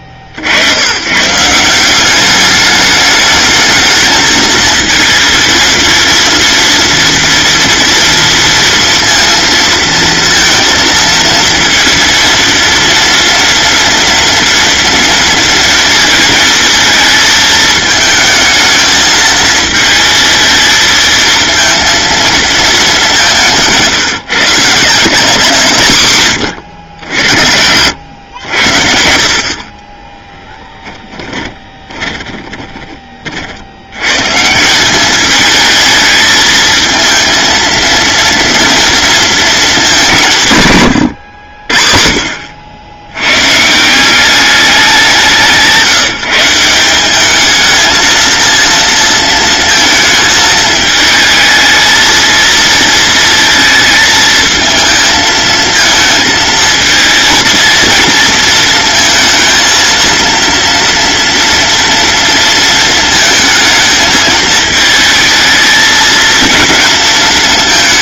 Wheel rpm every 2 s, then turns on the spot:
110, 210, 220, 230, 230, 230, 230, 230, 220, 220, 220, 200, 160, 70, 70, 10, 20, 190, 220, 230, 130, 90, 190, 180, 230, 220, 230, 220, 220, 230, 230, 230, 220, 220.
30-32